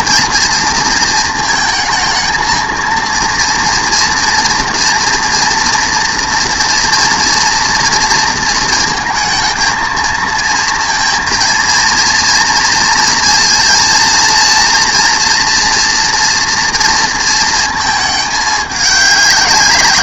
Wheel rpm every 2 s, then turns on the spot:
230, 230, 230, 230, 230, 230, 230, 240, 230, 210.
none